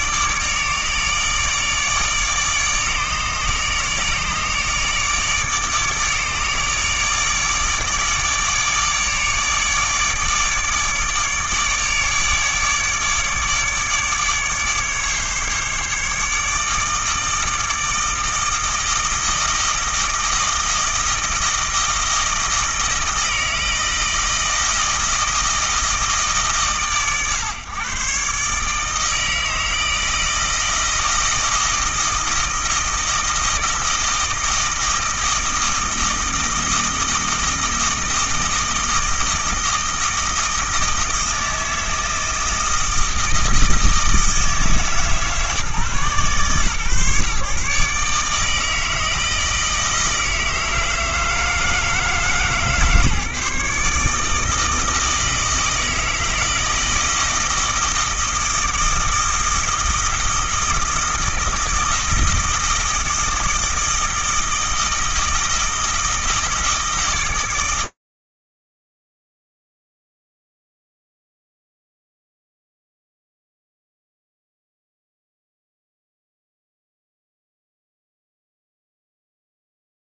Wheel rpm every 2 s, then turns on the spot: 150, 150, 150, 150, 150, 150, 150, 140, 160, 160, 160, 160, 160, 140, 150, 160, 160, 160, 160, 160, 160, 160, 160, 130, 160, 160, 150, 160, 160, 160, 160, 160, 160, 160, 60, 0, 0, 0, 0, 0.
none